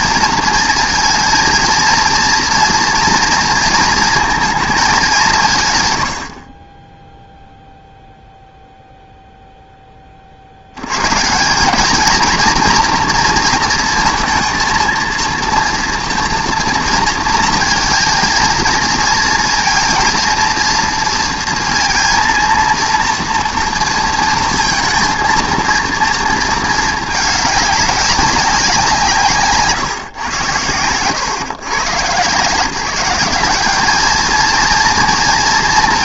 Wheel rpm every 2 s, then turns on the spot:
220, 230, 220, 30, 0, 70, 230, 230, 230, 230, 230, 230, 230, 220, 180, 110, 170, 230.
30-32